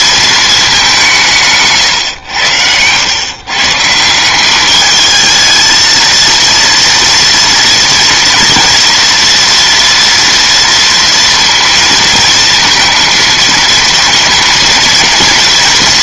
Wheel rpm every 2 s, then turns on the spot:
200, 100, 210, 230, 230, 230, 230, 230.
none